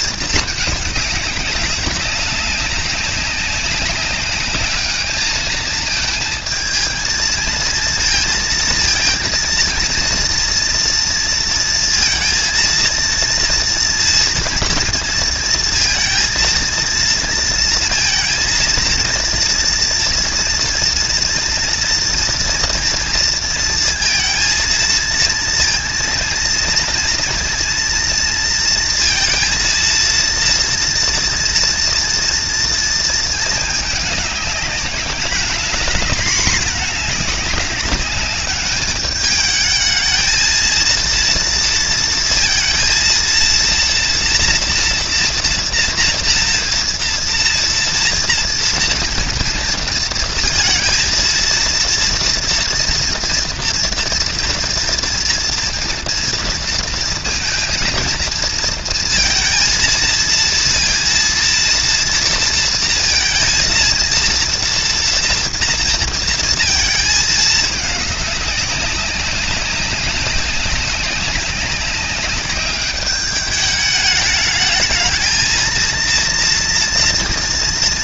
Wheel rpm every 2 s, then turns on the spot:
220, 190, 210, 220, 230, 230, 230, 230, 230, 230, 230, 230, 230, 230, 230, 230, 230, 200, 220, 210, 220, 230, 230, 230, 240, 230, 230, 230, 230, 230, 230, 230, 230, 230, 190, 190, 190, 210, 230.
none